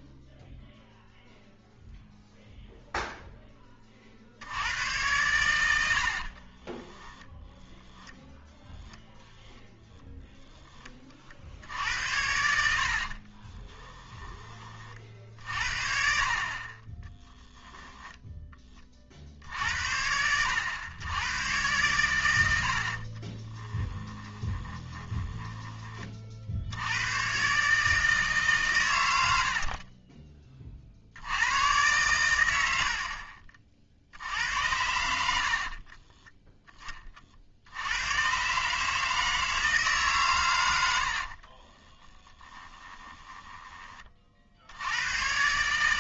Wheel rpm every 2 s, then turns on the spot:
0, 0, 90, 20, 10, 10, 70, 40, 30, 20, 100, 70, 20, 80, 130, 40, 80, 80, 20, 150, 90, 30, 80.
6-10 12-14 16-18 24-26 32-34 42-44